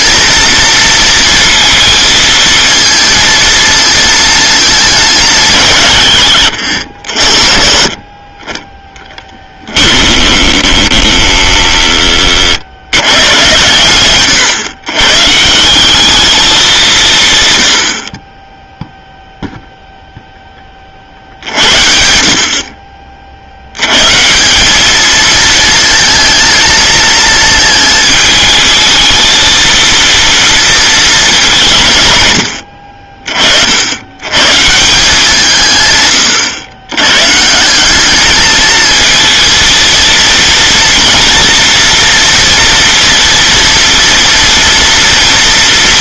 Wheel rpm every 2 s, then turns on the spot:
230, 230, 220, 100, 20, 20, 70, 120, 200, 0, 30, 40, 190, 220, 220, 230, 90, 150, 110, 220, 230, 240, 230.
6-8 10-12